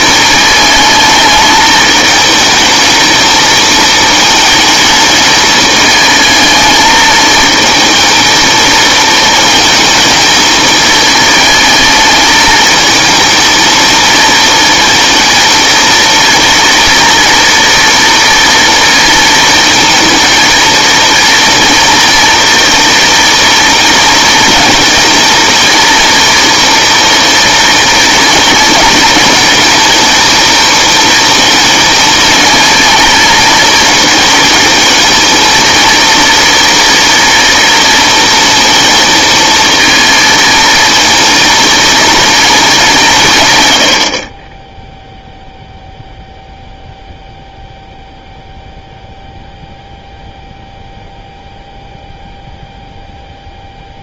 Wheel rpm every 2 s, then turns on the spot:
220, 220, 220, 220, 230, 220, 220, 230, 230, 230, 230, 230, 230, 230, 230, 230, 230, 230, 230, 230, 220, 180, 0, 0, 0, 0, 0.
none